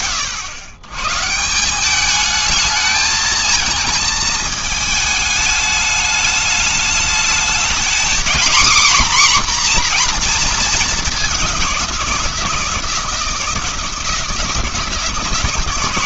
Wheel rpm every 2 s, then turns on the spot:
110, 220, 220, 210, 260, 210, 160, 160.
none